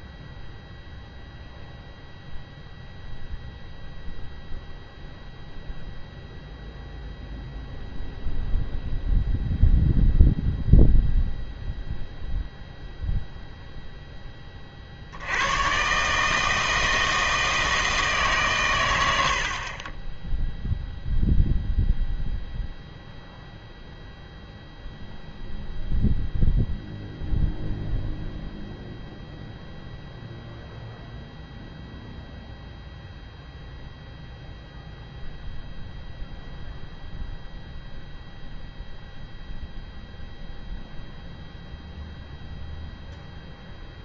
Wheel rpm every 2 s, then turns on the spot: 0, 0, 0, 0, 0, 0, 0, 30, 160, 120, 0, 0, 0, 0, 0, 0, 0, 0, 0, 0, 0, 0.
none